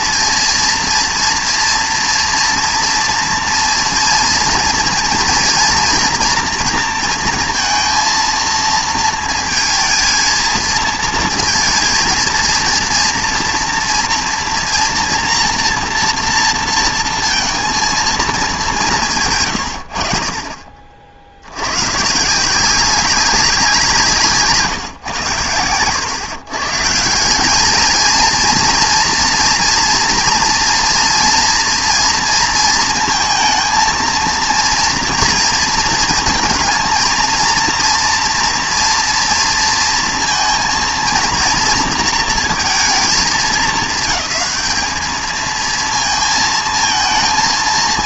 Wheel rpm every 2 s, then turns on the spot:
230, 230, 230, 230, 230, 230, 230, 230, 230, 190, 40, 170, 140, 130, 230, 240, 230, 230, 230, 230, 230, 230, 220, 220.
none